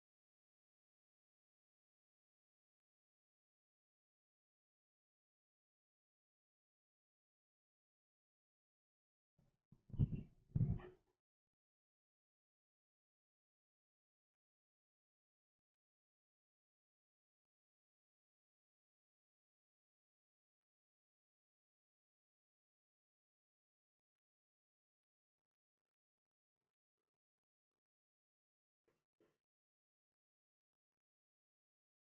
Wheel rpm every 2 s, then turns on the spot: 0, 0, 0, 0, 0, 0, 0, 0, 0, 0, 0, 0, 0, 0, 0, 0.
none